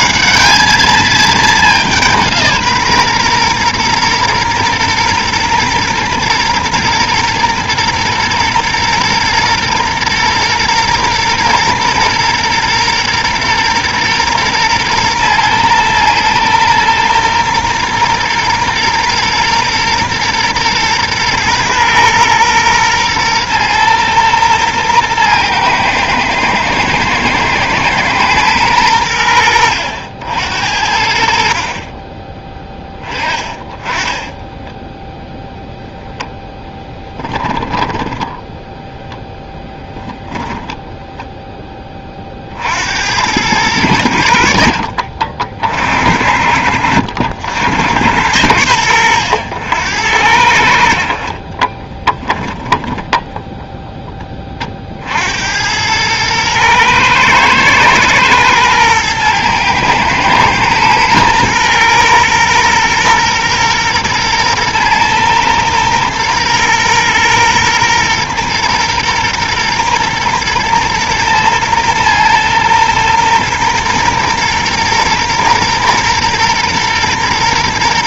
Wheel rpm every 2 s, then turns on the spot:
210, 150, 120, 120, 120, 120, 120, 120, 120, 120, 120, 120, 120, 110, 110, 70, 10, 10, 10, 10, 20, 60, 60, 70, 90, 70, 10, 40, 110, 120, 120, 120, 120, 120, 120, 120, 120, 120, 120.
34-36 40-42 52-54